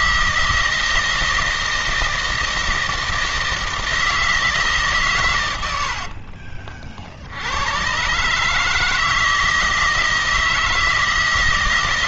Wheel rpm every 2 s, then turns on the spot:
160, 160, 160, 50, 140, 160.
6-8